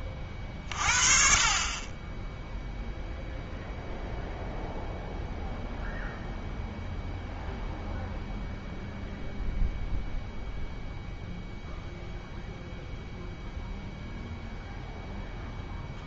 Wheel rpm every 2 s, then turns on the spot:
30, 0, 0, 0, 0, 0, 0, 0.
none